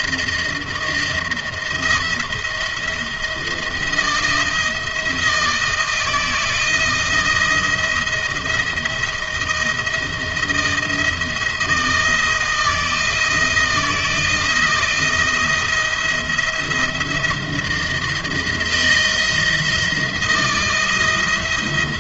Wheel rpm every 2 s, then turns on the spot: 170, 170, 170, 160, 170, 170, 160, 170, 170, 170, 170.
none